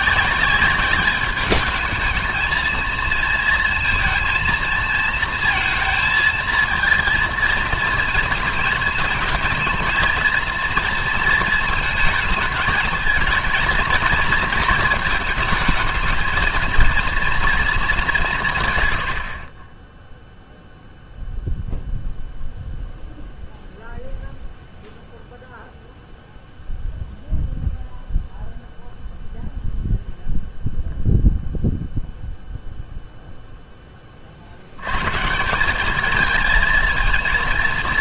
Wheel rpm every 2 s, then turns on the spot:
190, 220, 230, 230, 220, 230, 220, 230, 230, 150, 0, 0, 0, 0, 0, 0, 0, 70, 220.
none